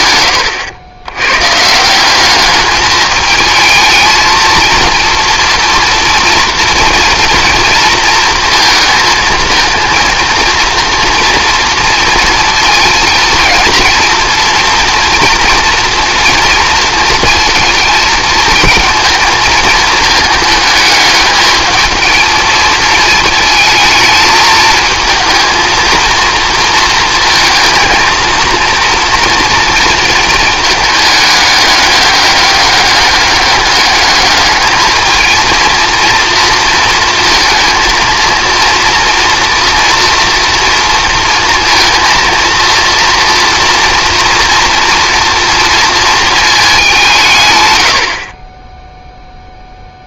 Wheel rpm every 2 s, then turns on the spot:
100, 210, 230, 230, 220, 230, 230, 230, 230, 220, 220, 220, 220, 230, 230, 220, 200, 210, 230, 230, 230, 230, 230, 190, 10.
none